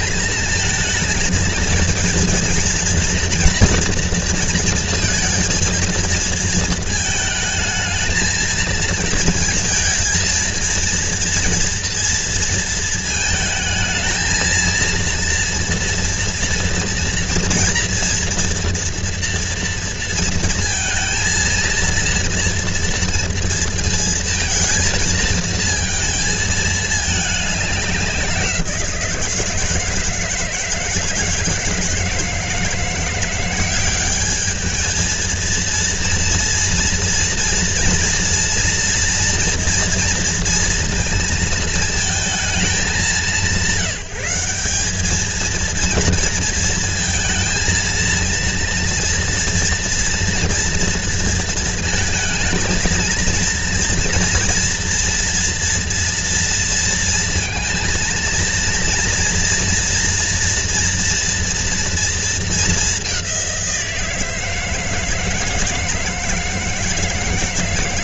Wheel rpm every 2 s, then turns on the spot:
220, 230, 230, 220, 220, 230, 230, 230, 240, 230, 220, 230, 230, 220, 170, 160, 170, 220, 230, 230, 230, 190, 200, 230, 230, 230, 220, 230, 230, 230, 240, 200, 160, 160.
none